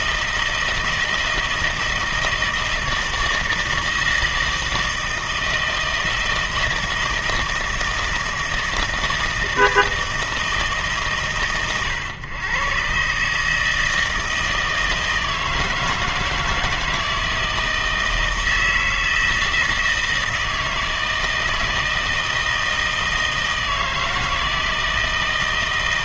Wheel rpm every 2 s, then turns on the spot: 160, 160, 160, 160, 160, 160, 120, 160, 160, 160, 160, 160, 160.
none